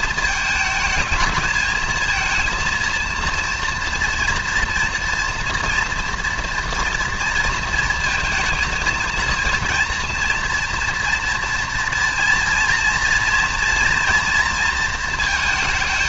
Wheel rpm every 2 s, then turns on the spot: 220, 230, 240, 230, 220, 230, 230, 230.
none